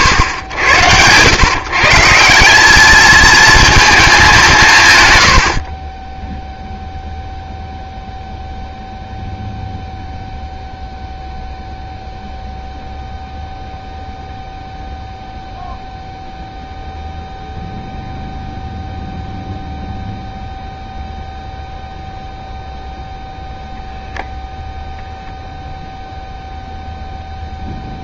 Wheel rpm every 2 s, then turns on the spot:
110, 200, 160, 0, 0, 0, 0, 0, 0, 0, 0, 0, 0, 0.
none